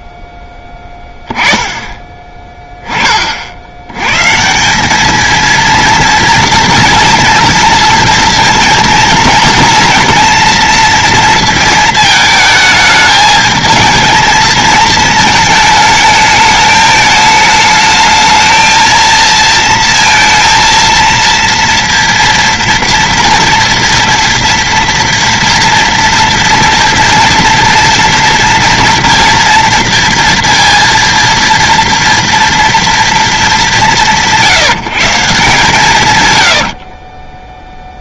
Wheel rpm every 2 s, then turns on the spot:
10, 10, 190, 230, 230, 230, 220, 220, 210, 220, 230, 230, 230, 230, 230, 230, 230, 160, 70.
36-38